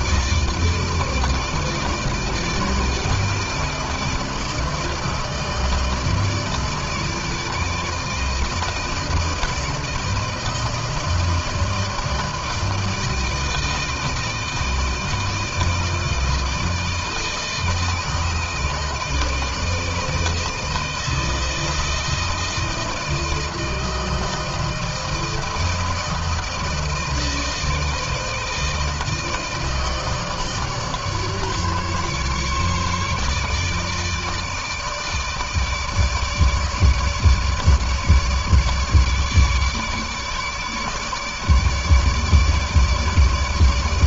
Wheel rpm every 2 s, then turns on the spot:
160, 160, 160, 160, 160, 160, 160, 160, 160, 160, 160, 160, 160, 160, 160, 150, 150, 160, 150, 150, 150, 150.
none